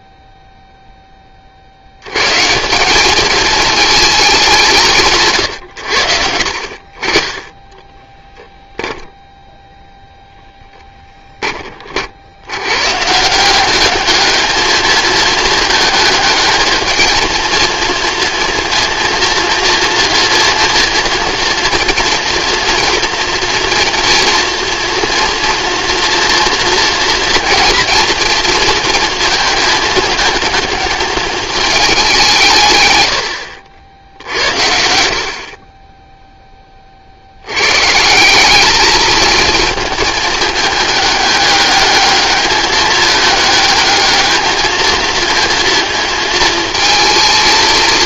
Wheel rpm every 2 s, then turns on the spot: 0, 150, 170, 50, 0, 10, 150, 220, 220, 230, 230, 230, 230, 230, 230, 220, 110, 60, 50, 220, 210, 210, 230, 220.
6-8